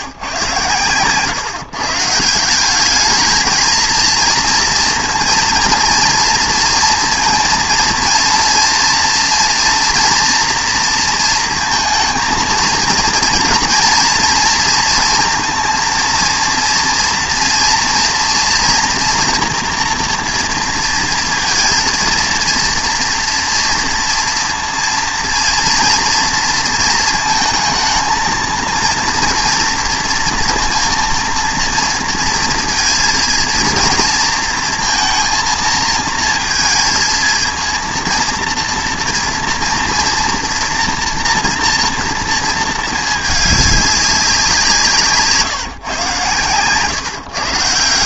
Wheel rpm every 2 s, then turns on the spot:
120, 200, 230, 230, 230, 230, 220, 230, 230, 230, 230, 230, 230, 230, 230, 230, 230, 230, 220, 230, 230, 220, 170, 140.
none